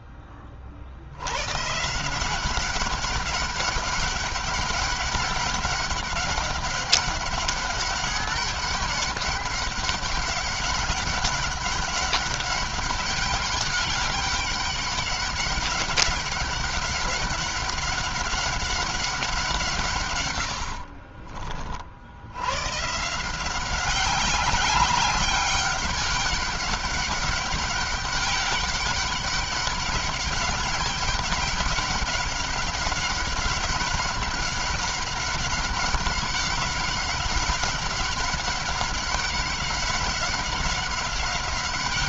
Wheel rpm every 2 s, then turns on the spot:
50, 190, 200, 200, 200, 200, 200, 200, 190, 190, 60, 130, 190, 200, 200, 200, 200, 190, 190, 200, 190.
20-22